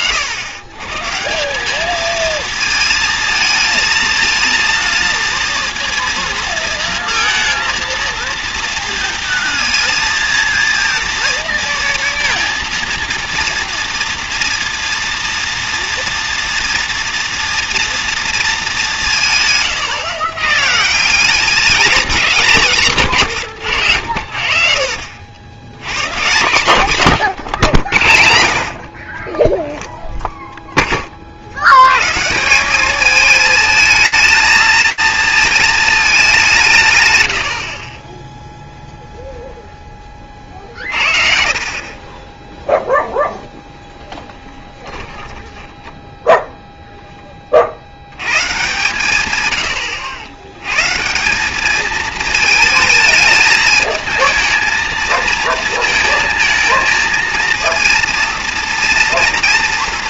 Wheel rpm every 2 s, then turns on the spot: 120, 220, 230, 230, 230, 230, 230, 230, 230, 200, 160, 180, 60, 140, 60, 0, 180, 220, 160, 0, 40, 0, 20, 0, 120, 120, 220, 220, 220, 230.
24-26 40-42 44-46